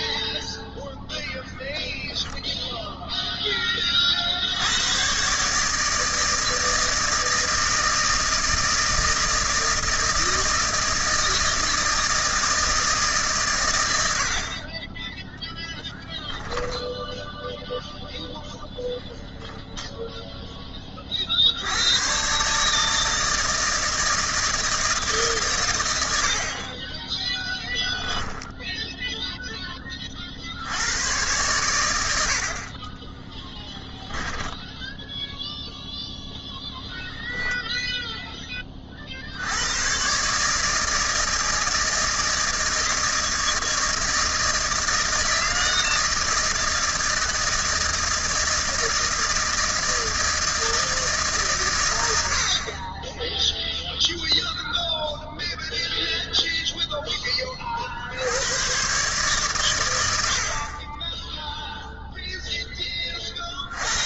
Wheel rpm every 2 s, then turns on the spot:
0, 0, 80, 160, 160, 160, 160, 40, 0, 0, 10, 140, 160, 40, 0, 70, 60, 10, 0, 20, 150, 160, 160, 160, 160, 160, 50, 0, 0, 100, 40, 10.
34-36